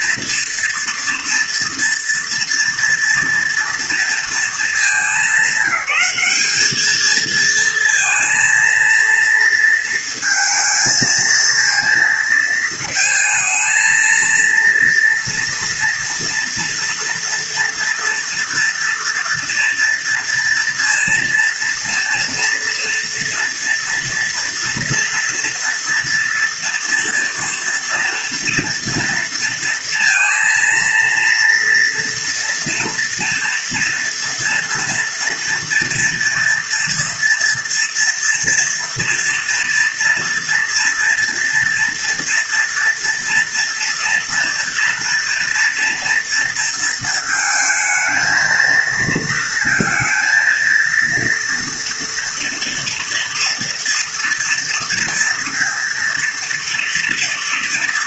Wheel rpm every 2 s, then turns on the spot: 230, 230, 210, 210, 230, 220, 220, 230, 240, 230, 230, 230, 230, 230, 230, 230, 230, 230, 230, 230, 230, 240, 230, 230, 220, 230, 230, 230, 230.
none